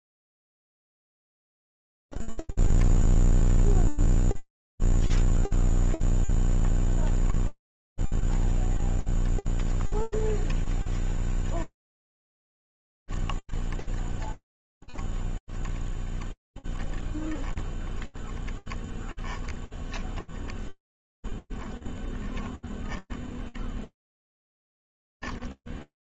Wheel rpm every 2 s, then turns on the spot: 0, 0, 0, 0, 0, 0, 0, 0, 0, 0, 0, 0, 0.
none